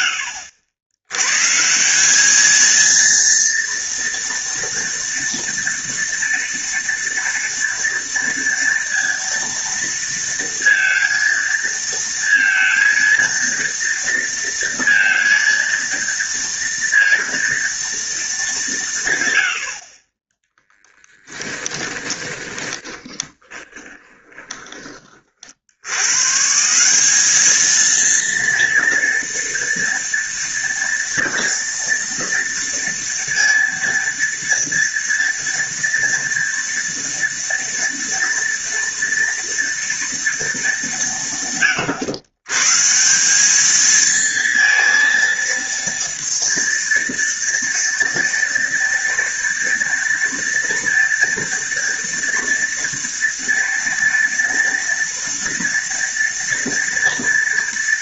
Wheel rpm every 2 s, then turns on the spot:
90, 230, 230, 230, 230, 230, 230, 230, 230, 130, 10, 20, 40, 200, 230, 230, 230, 230, 230, 230, 160, 170, 230, 230, 230, 230, 230, 230, 230.
20-24